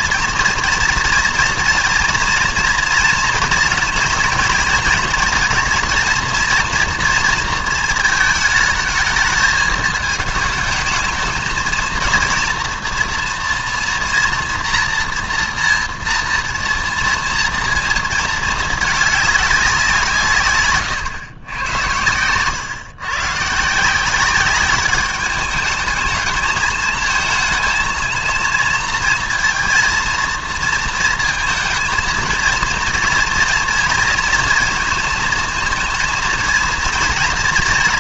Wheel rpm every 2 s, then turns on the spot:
230, 230, 230, 240, 220, 220, 230, 240, 230, 220, 130, 110, 200, 220, 230, 230, 230, 230, 230.
none